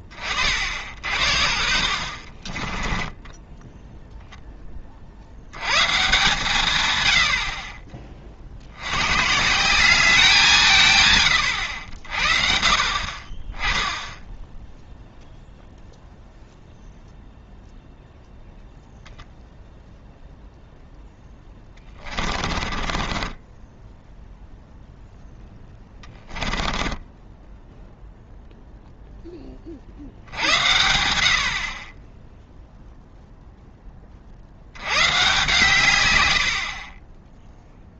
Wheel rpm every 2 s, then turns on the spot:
40, 20, 20, 130, 80, 160, 50, 0, 0, 0, 0, 40, 0, 10, 0, 80, 0, 90, 50.
2-4 22-24 26-28